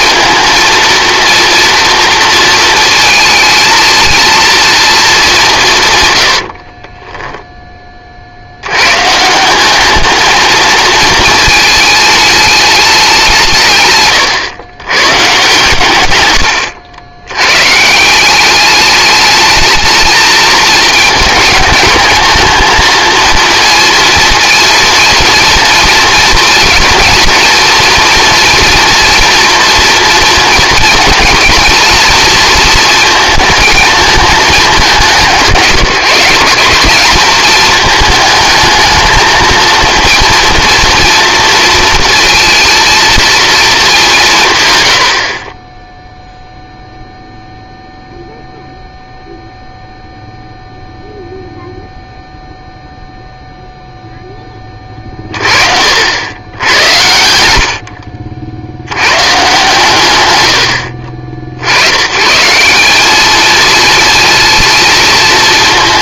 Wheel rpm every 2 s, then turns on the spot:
230, 220, 230, 40, 100, 220, 210, 120, 90, 200, 220, 220, 230, 230, 230, 230, 230, 210, 180, 220, 230, 230, 110, 0, 0, 0, 0, 30, 100, 70, 90, 180, 230.
6-8 54-56